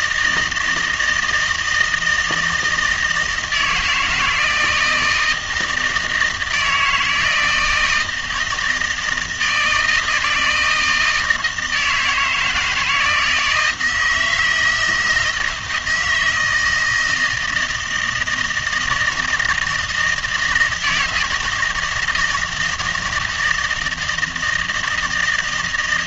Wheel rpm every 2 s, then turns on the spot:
160, 160, 170, 160, 160, 160, 160, 160, 160, 160, 160, 160, 160.
none